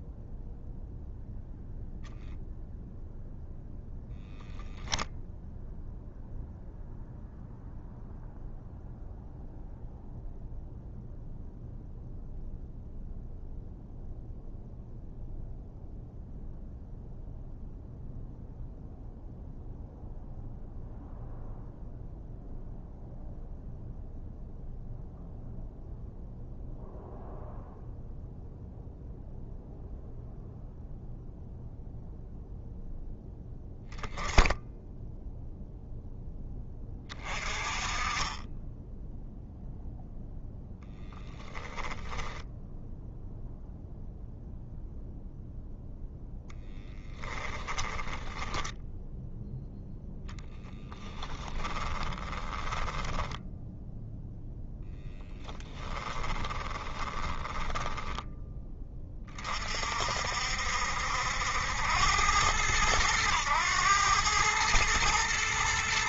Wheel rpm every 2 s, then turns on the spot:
0, 0, 0, 0, 0, 0, 0, 0, 0, 0, 0, 0, 0, 0, 0, 0, 0, 0, 30, 0, 10, 0, 0, 10, 0, 20, 20, 20, 20, 40, 80, 100, 110.
46-48 50-54 56-58